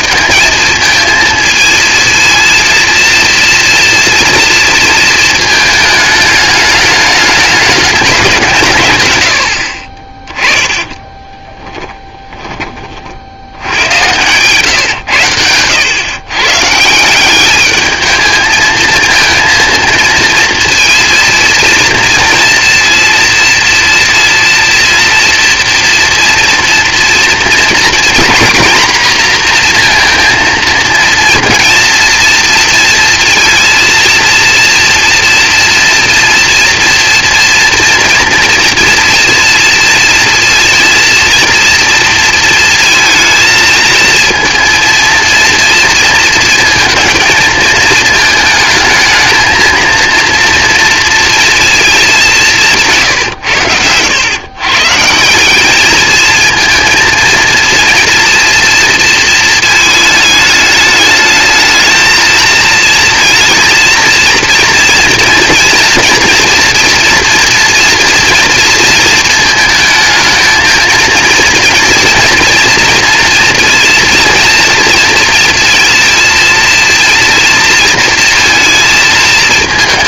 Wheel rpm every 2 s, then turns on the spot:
220, 230, 230, 210, 170, 10, 30, 120, 140, 220, 230, 240, 240, 230, 230, 230, 230, 230, 230, 230, 230, 230, 230, 220, 220, 230, 180, 130, 230, 230, 210, 220, 230, 230, 230, 220, 230, 230, 230, 230.
10-12